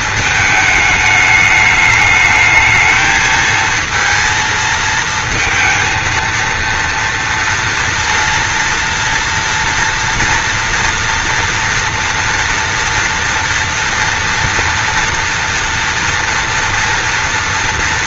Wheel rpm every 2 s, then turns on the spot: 210, 220, 230, 230, 230, 230, 240, 240, 230.
none